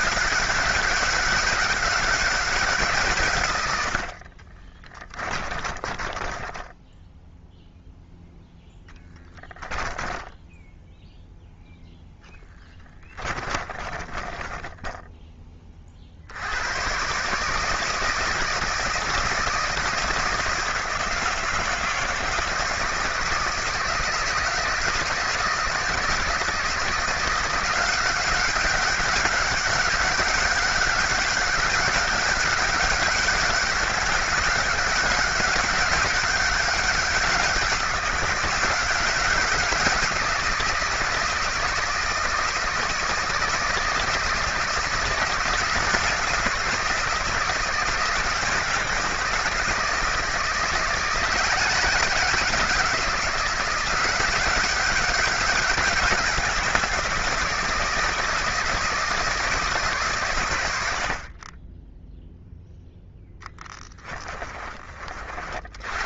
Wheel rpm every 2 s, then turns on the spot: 190, 180, 30, 10, 10, 10, 20, 10, 90, 160, 160, 160, 160, 160, 190, 190, 200, 200, 190, 180, 170, 160, 170, 170, 170, 160, 190, 190, 180, 170, 110, 0, 30.
4-8 10-16